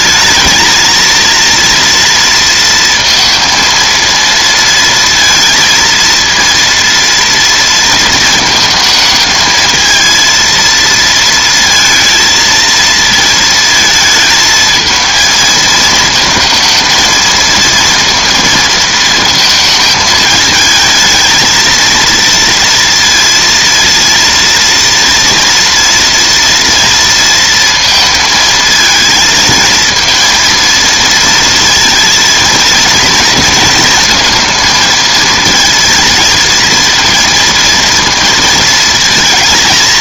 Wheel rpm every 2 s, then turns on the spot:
220, 230, 230, 230, 220, 230, 230, 220, 230, 230, 220, 230, 230, 230, 220, 230, 220, 220, 230, 230.
none